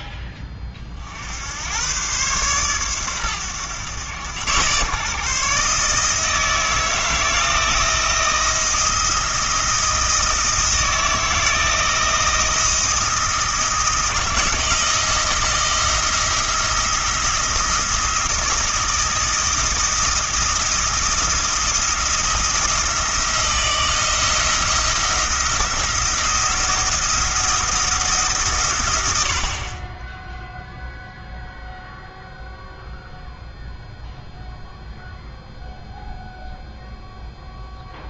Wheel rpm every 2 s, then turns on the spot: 40, 120, 130, 160, 160, 160, 170, 160, 170, 170, 170, 160, 170, 170, 110, 0, 0, 0, 0.
none